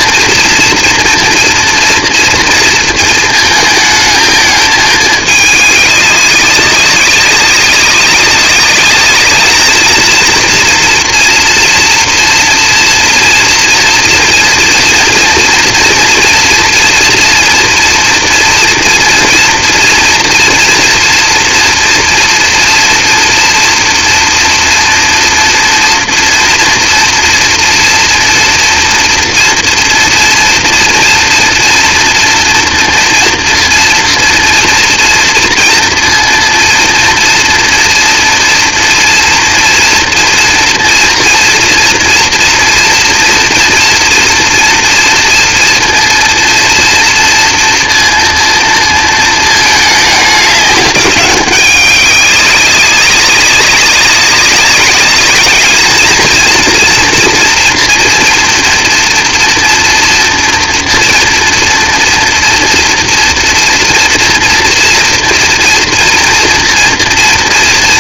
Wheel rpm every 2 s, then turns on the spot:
230, 230, 220, 190, 190, 230, 240, 230, 240, 230, 230, 230, 230, 230, 230, 240, 230, 240, 230, 230, 230, 230, 240, 230, 230, 200, 200, 200, 230, 240, 230, 230, 230, 230.
none